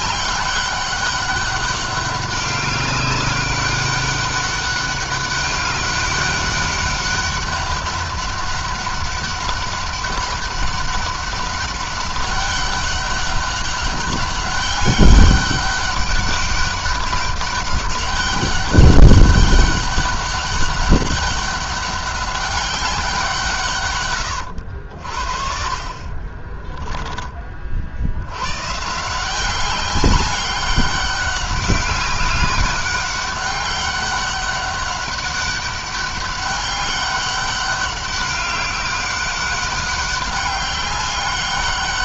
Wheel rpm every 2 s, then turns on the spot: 200, 190, 200, 200, 200, 200, 200, 200, 200, 200, 200, 200, 90, 30, 120, 200, 200, 200, 200, 200, 200.
26-28